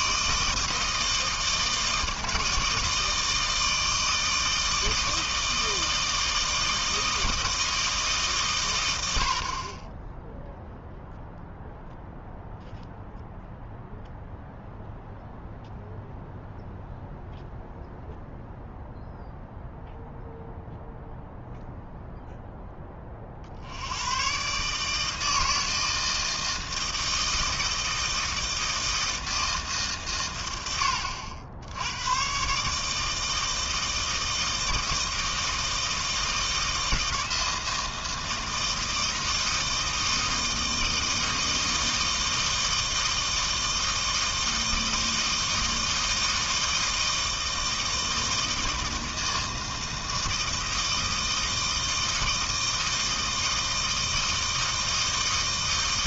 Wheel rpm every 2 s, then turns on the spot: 160, 160, 160, 160, 120, 0, 0, 0, 0, 0, 0, 10, 150, 160, 160, 100, 140, 160, 160, 160, 160, 160, 160, 160, 160, 160, 160, 160.
none